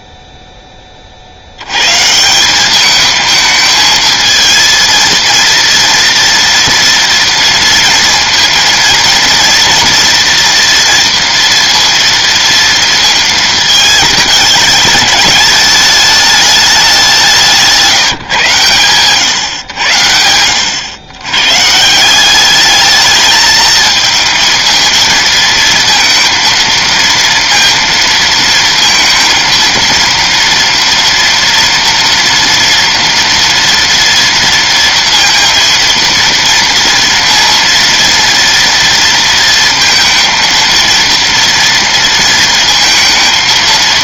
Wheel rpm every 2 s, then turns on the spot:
10, 190, 230, 230, 230, 230, 230, 210, 210, 120, 90, 200, 220, 230, 230, 230, 230, 230, 230, 230, 230, 230.
none